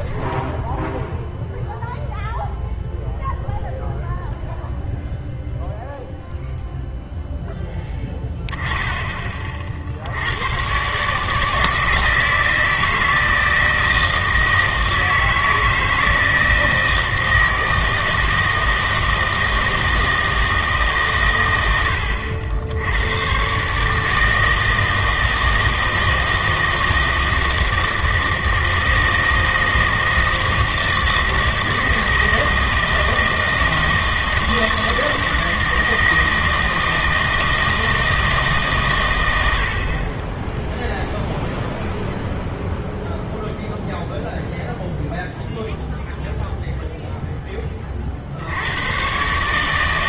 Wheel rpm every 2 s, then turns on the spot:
0, 0, 0, 0, 10, 120, 160, 160, 160, 160, 150, 80, 160, 160, 160, 160, 160, 160, 160, 130, 0, 0, 0, 0, 100.
none